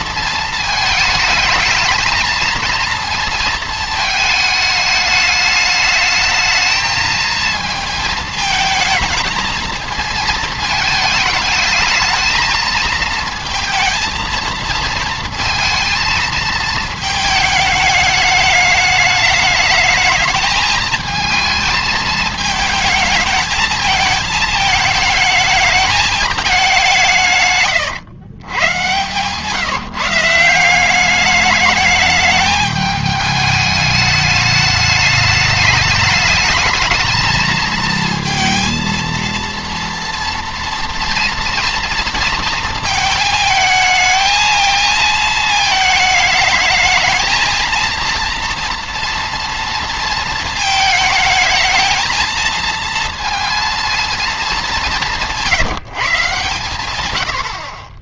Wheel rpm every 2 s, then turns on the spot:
220, 230, 210, 220, 220, 220, 220, 230, 220, 210, 220, 220, 220, 200, 120, 180, 210, 210, 220, 230, 230, 230, 220, 220, 230, 220, 230, 200, 130.
none